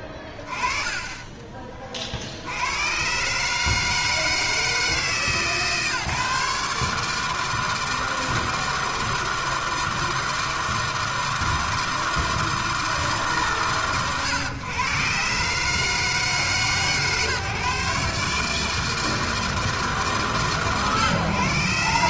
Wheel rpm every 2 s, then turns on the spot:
20, 90, 160, 150, 160, 160, 160, 120, 140, 150, 120.
0-2